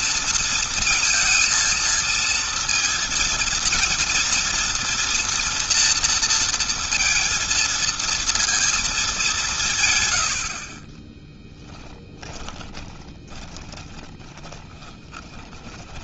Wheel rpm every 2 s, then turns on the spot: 230, 230, 230, 230, 210, 40, 20, 20.
10-16